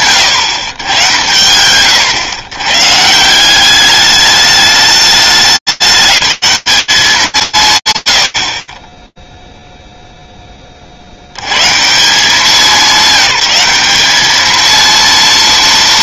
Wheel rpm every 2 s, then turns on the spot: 100, 150, 210, 210, 50, 30, 180, 220.
none